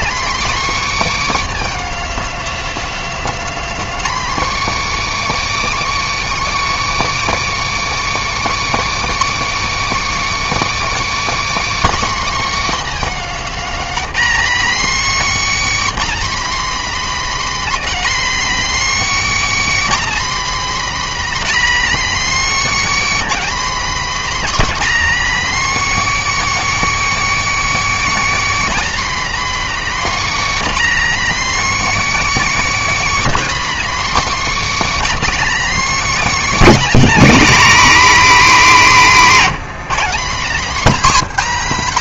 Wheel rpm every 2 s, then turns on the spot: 310, 260, 260, 270, 280, 330, 300, 280, 300, 300, 300, 300, 300, 320, 310, 300, 310, 310, 300, 250, 250.
none